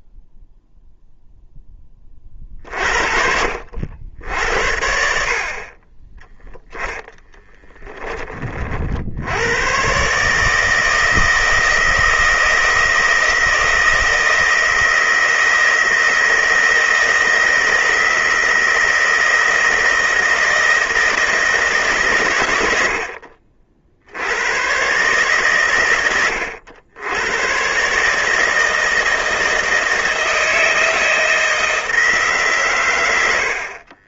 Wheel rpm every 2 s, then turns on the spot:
0, 50, 70, 20, 50, 160, 160, 160, 160, 160, 160, 100, 120, 90, 160, 160, 120.
6-8